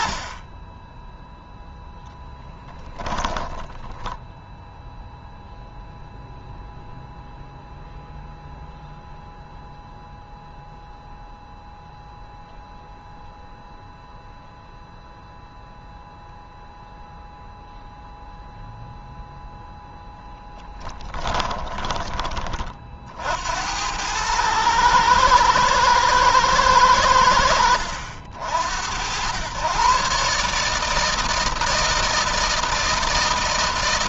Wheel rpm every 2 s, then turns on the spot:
40, 10, 0, 0, 0, 0, 0, 0, 0, 0, 10, 30, 100, 110, 70, 140, 160.
none